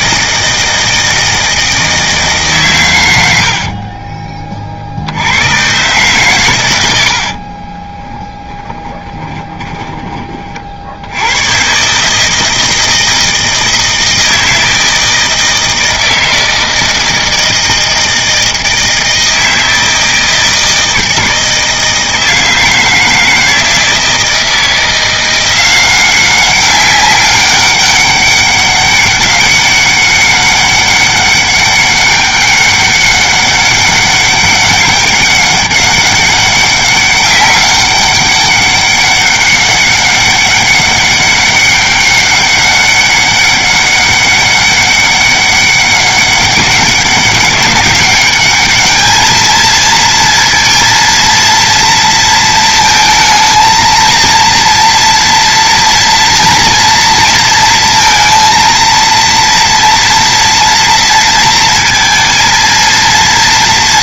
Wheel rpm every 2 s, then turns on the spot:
160, 130, 40, 110, 20, 50, 160, 160, 160, 160, 160, 160, 170, 200, 200, 200, 200, 200, 200, 200, 200, 200, 200, 200, 210, 230, 230, 230, 230, 230, 230, 230.
8-10